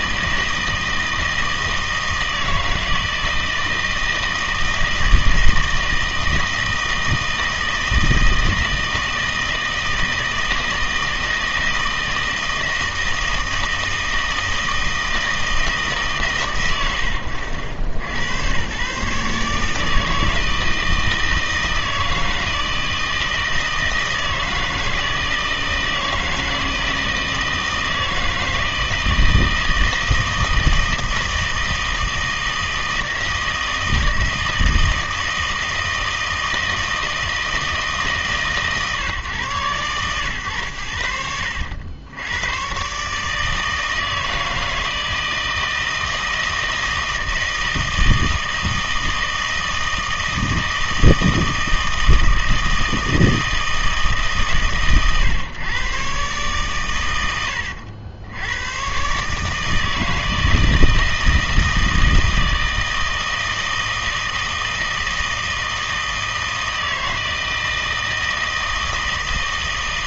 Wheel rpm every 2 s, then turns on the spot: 160, 160, 160, 160, 160, 160, 160, 160, 110, 120, 160, 160, 160, 160, 160, 160, 160, 160, 160, 140, 110, 120, 160, 160, 160, 160, 160, 130, 110, 110, 160, 160, 160, 160, 160.
none